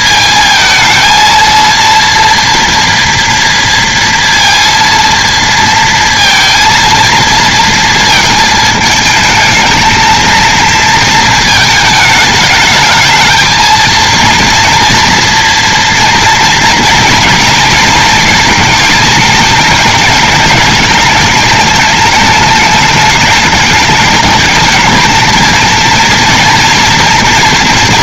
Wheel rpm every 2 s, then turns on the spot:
230, 230, 230, 230, 220, 230, 210, 230, 230, 220, 210, 210, 220, 230.
none